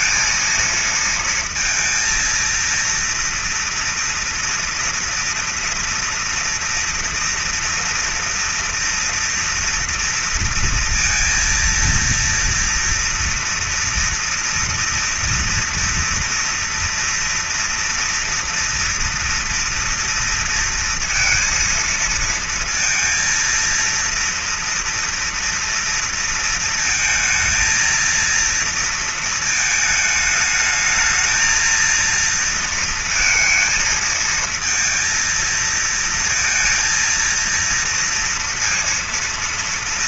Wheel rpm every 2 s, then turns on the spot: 230, 230, 230, 230, 230, 230, 230, 230, 240, 240, 230, 230, 230, 230, 230, 220, 230, 230, 230, 230.
none